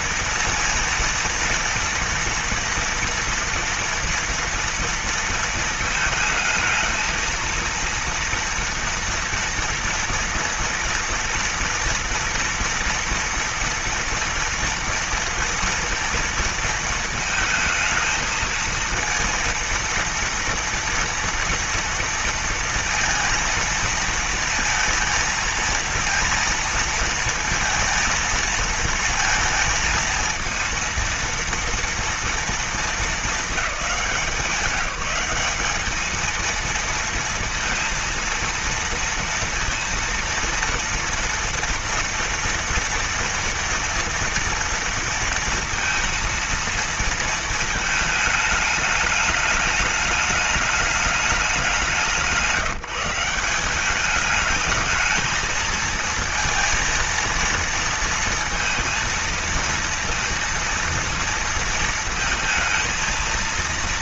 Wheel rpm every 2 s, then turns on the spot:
230, 230, 230, 220, 230, 230, 230, 230, 230, 230, 230, 230, 230, 230, 230, 230, 220, 180, 230, 230, 230, 230, 230, 230, 210, 210, 170, 220, 230, 230, 230, 230.
none